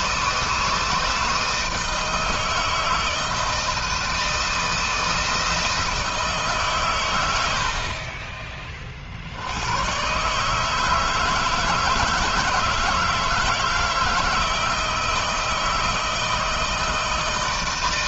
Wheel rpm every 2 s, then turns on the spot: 160, 160, 160, 140, 40, 150, 160, 160, 160.
none